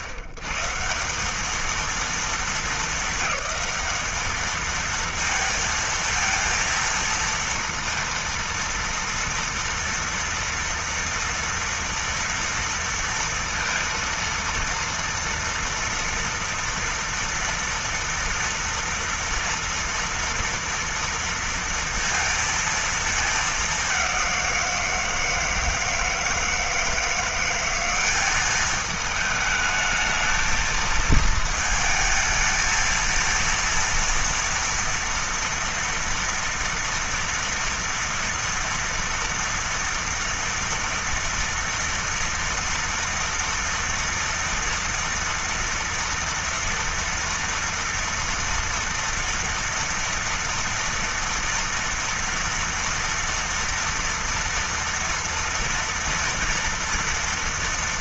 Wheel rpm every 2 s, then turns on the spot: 130, 220, 220, 230, 230, 230, 230, 230, 230, 230, 230, 230, 190, 160, 200, 220, 220, 230, 230, 230, 230, 230, 230, 230, 230, 230, 230, 230, 230.
none